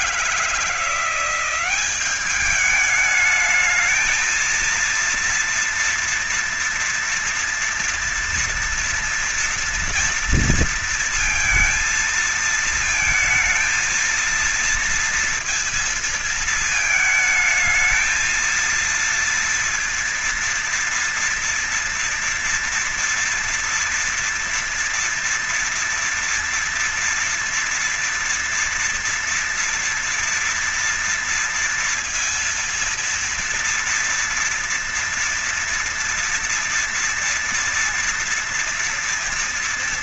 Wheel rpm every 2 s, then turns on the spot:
160, 200, 220, 240, 230, 230, 220, 230, 230, 220, 230, 230, 230, 240, 240, 230, 230, 230, 230, 240.
none